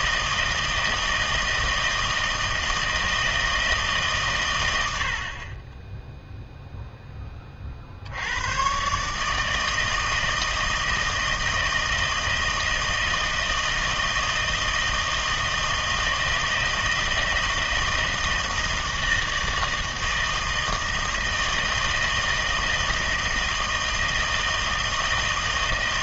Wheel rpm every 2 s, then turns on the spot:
160, 160, 90, 0, 130, 160, 160, 160, 160, 160, 160, 160, 160.
none